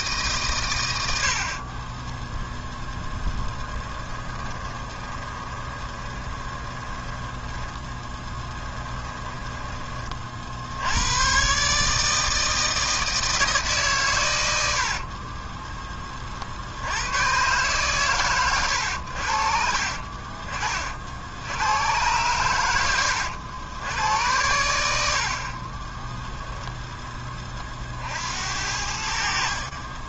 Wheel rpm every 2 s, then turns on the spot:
140, 10, 20, 20, 10, 70, 160, 80, 60, 110, 40, 100, 80, 0, 80.
4-10 14-16